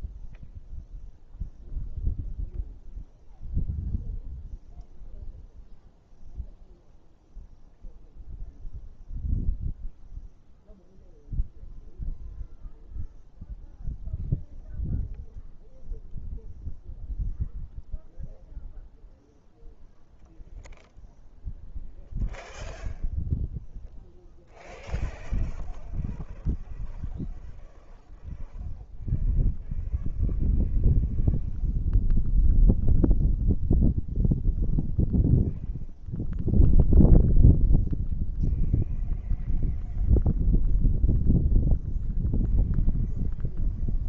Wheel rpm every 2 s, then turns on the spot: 0, 0, 0, 0, 0, 0, 0, 0, 0, 0, 0, 0, 0, 0, 0, 0, 0, 0, 0, 0, 0, 0.
none